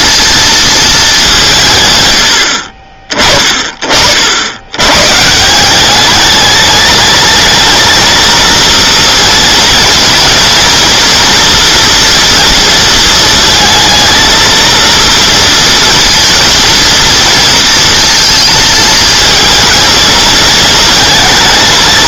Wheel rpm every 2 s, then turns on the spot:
220, 60, 100, 210, 230, 230, 230, 230, 230, 220, 220.
none